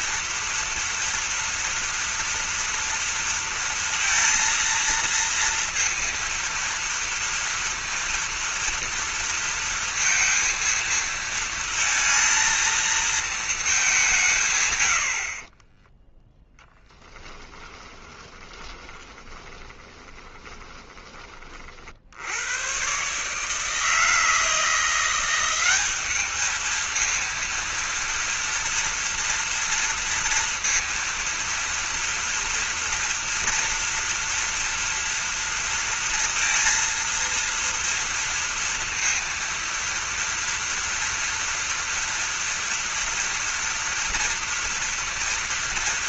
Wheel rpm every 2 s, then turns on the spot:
230, 230, 230, 230, 230, 230, 220, 140, 10, 20, 20, 120, 170, 220, 230, 230, 240, 240, 230, 230, 240, 230, 230.
16-22